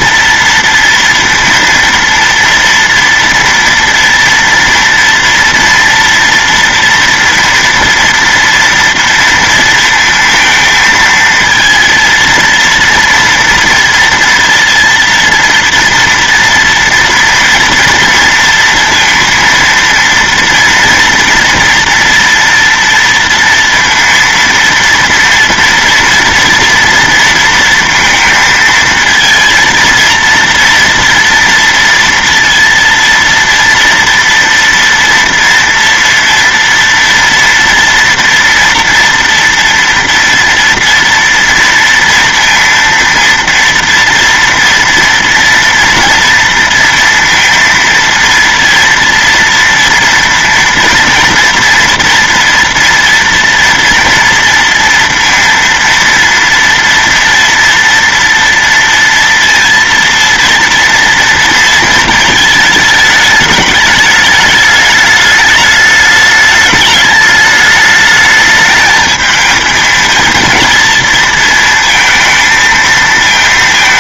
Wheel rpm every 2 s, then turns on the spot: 230, 230, 230, 230, 230, 230, 230, 230, 230, 230, 240, 230, 230, 230, 220, 230, 230, 230, 230, 230, 230, 230, 230, 230, 230, 230, 240, 230, 230, 230, 230, 220, 210, 210, 220, 230, 220.
none